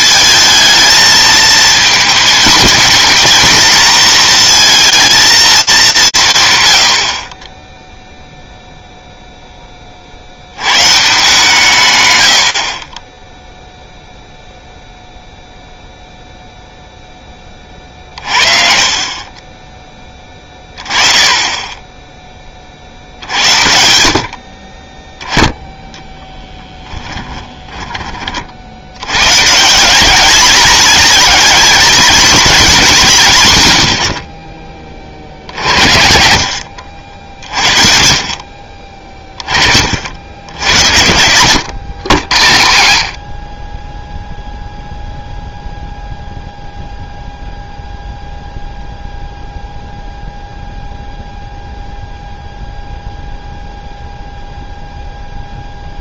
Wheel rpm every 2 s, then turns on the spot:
220, 230, 230, 110, 0, 120, 40, 0, 0, 40, 10, 40, 40, 10, 70, 220, 200, 30, 70, 30, 90, 90, 0, 0, 0, 0, 0, 0.
26-28 36-38